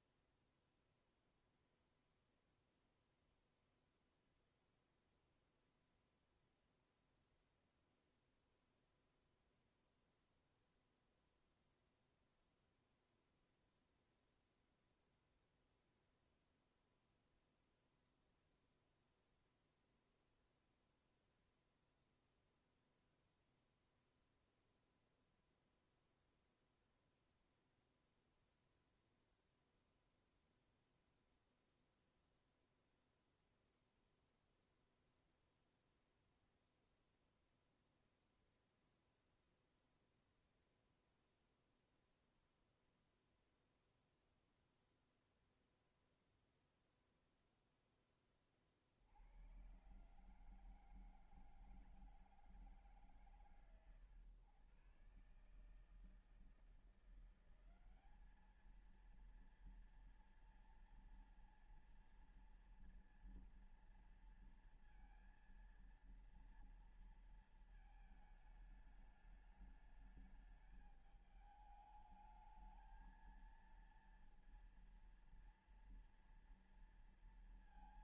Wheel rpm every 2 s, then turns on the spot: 0, 0, 0, 0, 0, 0, 0, 0, 0, 0, 0, 0, 0, 0, 0, 0, 0, 0, 0, 0, 0, 0, 0, 0, 70, 160, 140, 140, 170, 230, 230, 230, 230, 230, 210, 210, 220, 230, 230.
none